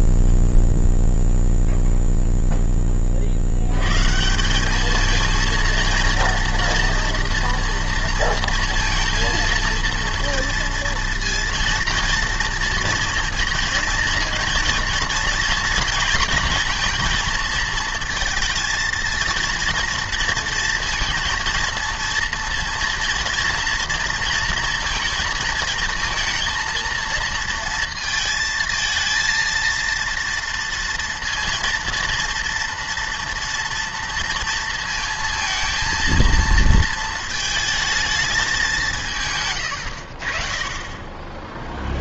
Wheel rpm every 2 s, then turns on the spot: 0, 0, 130, 230, 230, 230, 230, 220, 240, 230, 230, 230, 230, 230, 230, 230, 230, 230, 230, 190, 30.
none